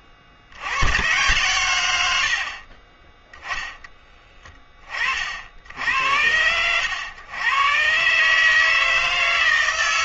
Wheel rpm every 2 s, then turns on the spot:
70, 20, 10, 110, 150.
none